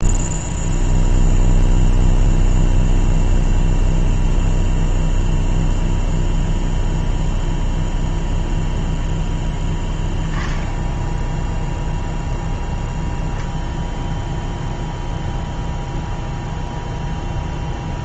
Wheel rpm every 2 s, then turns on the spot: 0, 0, 0, 0, 0, 10, 0, 0, 0.
none